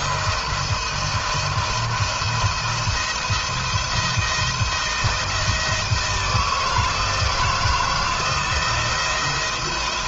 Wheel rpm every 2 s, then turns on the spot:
170, 170, 160, 160, 170.
none